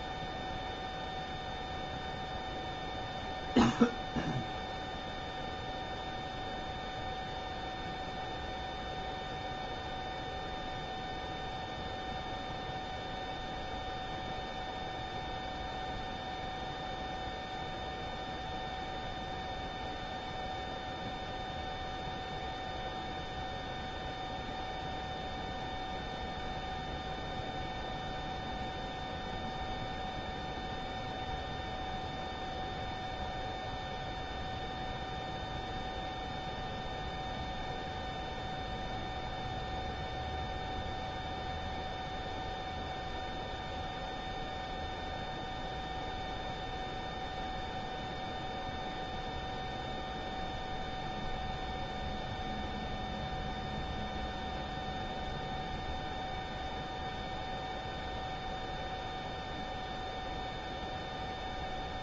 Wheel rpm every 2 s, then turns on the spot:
0, 0, 0, 0, 0, 0, 0, 0, 0, 0, 0, 0, 0, 0, 0, 0, 0, 0, 0, 0, 0, 0, 0, 0, 0, 0, 0, 0, 0, 0, 0.
none